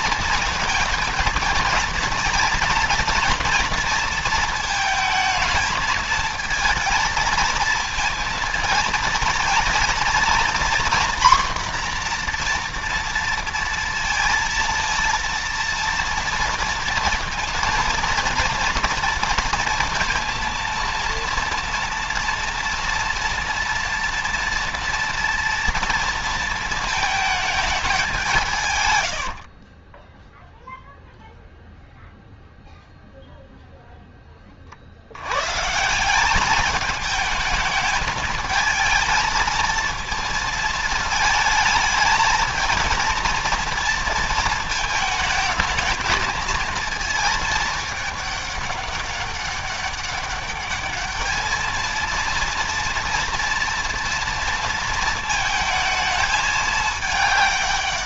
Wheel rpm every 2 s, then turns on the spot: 230, 230, 220, 220, 230, 240, 240, 230, 230, 230, 230, 230, 230, 230, 160, 0, 0, 30, 200, 220, 220, 220, 220, 220, 200, 200, 230, 230, 220.
28-30